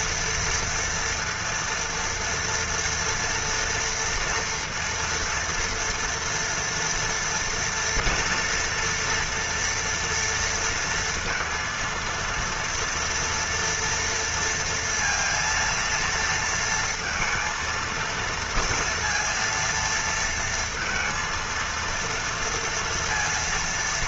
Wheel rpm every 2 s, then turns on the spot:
230, 230, 230, 230, 240, 230, 230, 230, 230, 230, 230, 230.
none